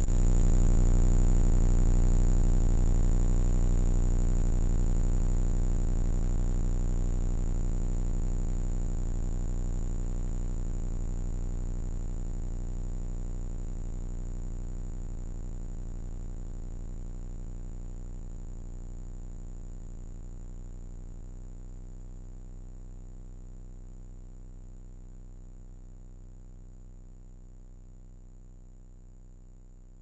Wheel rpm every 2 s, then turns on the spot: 0, 0, 0, 0, 0, 0, 0, 0, 0, 0, 0, 0, 0, 0, 0.
none